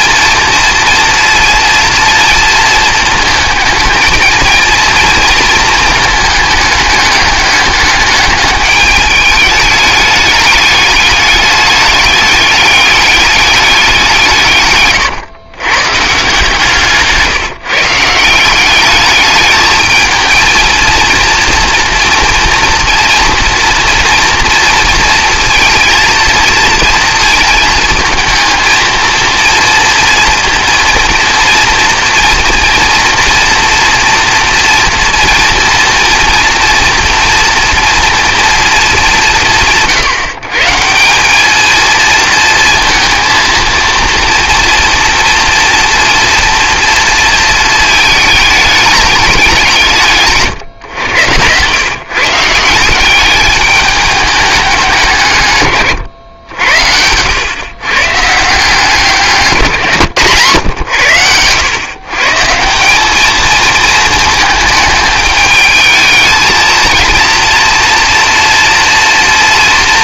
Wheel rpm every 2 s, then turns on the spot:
230, 220, 230, 210, 210, 210, 200, 130, 150, 200, 230, 230, 230, 230, 230, 230, 230, 230, 230, 220, 170, 230, 230, 230, 220, 130, 170, 190, 90, 160, 110, 170, 220, 230, 230.
14-16